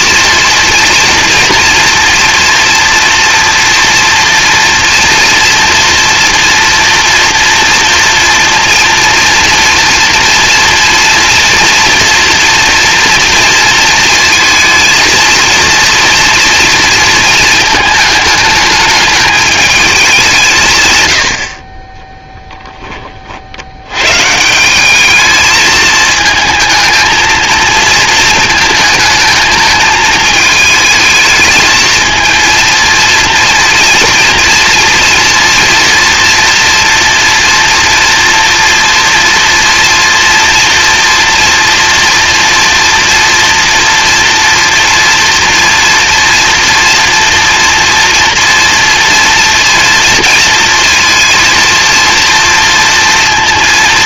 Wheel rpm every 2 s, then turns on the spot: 230, 230, 230, 240, 240, 230, 240, 230, 230, 210, 150, 10, 170, 220, 220, 220, 220, 230, 230, 230, 230, 230, 240, 230, 230, 230, 230.
none